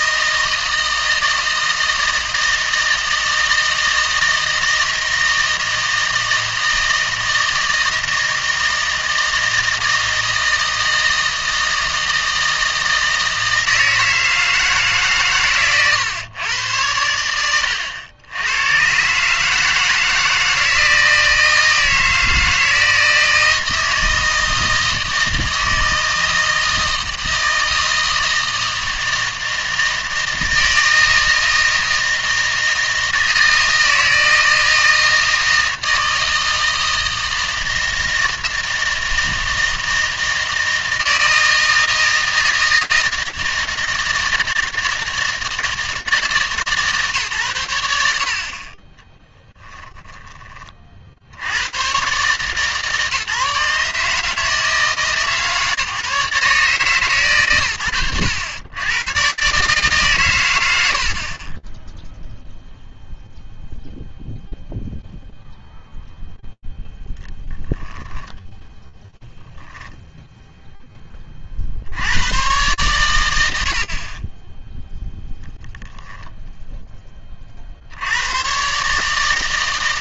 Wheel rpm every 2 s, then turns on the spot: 160, 160, 160, 160, 160, 160, 160, 150, 100, 110, 160, 160, 160, 160, 160, 160, 160, 160, 160, 160, 160, 160, 160, 150, 40, 50, 140, 160, 140, 80, 110, 0, 0, 10, 10, 10, 120, 0, 10, 140.
none